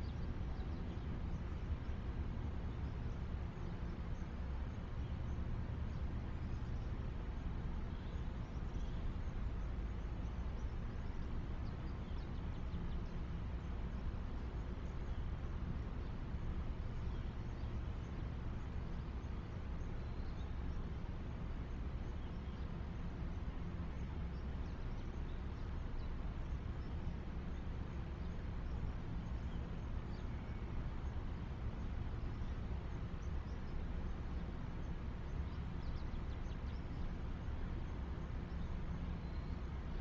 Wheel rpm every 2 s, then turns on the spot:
0, 0, 0, 0, 0, 0, 0, 0, 0, 0, 0, 0, 0, 0, 0, 0, 0, 0, 0, 0.
none